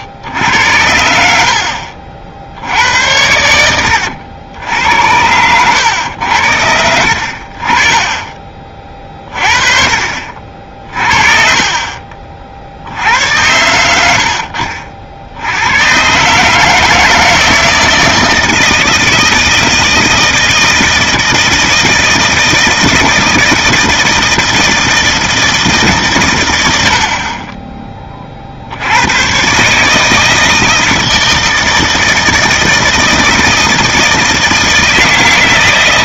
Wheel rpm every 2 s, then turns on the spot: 70, 100, 90, 70, 30, 40, 40, 60, 160, 160, 160, 160, 160, 70, 100, 160, 160, 160.
none